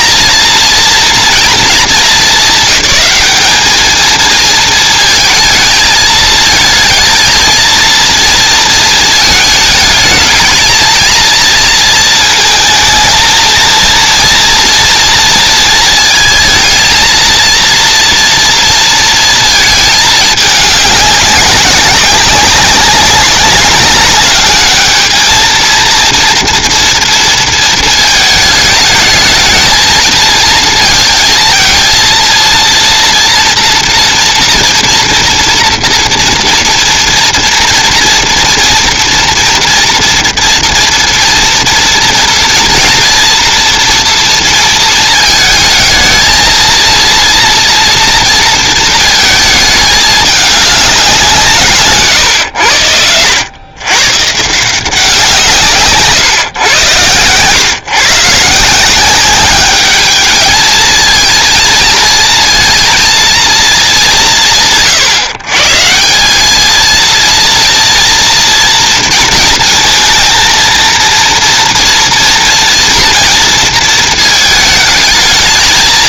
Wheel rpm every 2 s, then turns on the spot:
230, 220, 220, 220, 230, 220, 220, 230, 220, 230, 210, 200, 210, 230, 220, 230, 230, 240, 240, 230, 230, 230, 230, 230, 230, 200, 100, 160, 120, 160, 220, 230, 120, 220, 230, 230, 230, 220.
none